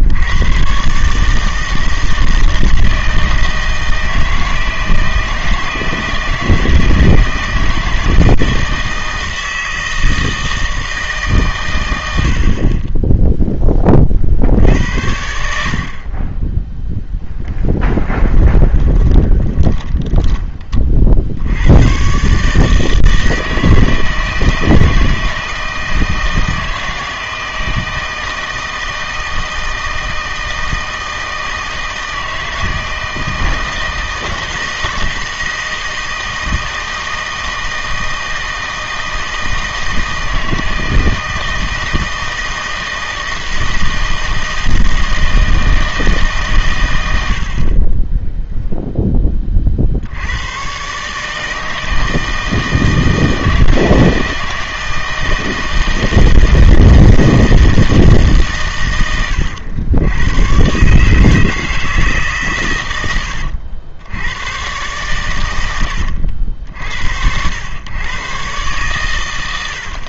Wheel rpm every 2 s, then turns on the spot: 120, 160, 160, 160, 160, 160, 30, 70, 10, 20, 30, 150, 160, 160, 160, 160, 160, 160, 160, 160, 160, 160, 160, 120, 0, 120, 160, 160, 160, 120, 130, 120, 130, 80, 130.
18-20